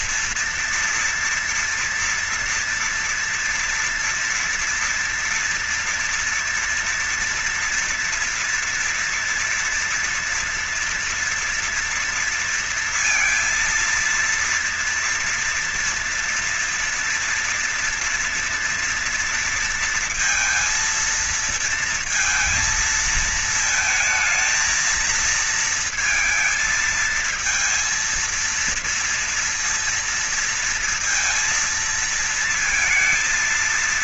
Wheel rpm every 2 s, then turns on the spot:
230, 230, 230, 230, 230, 230, 230, 230, 240, 240, 230, 230, 220, 230, 230, 230, 230.
none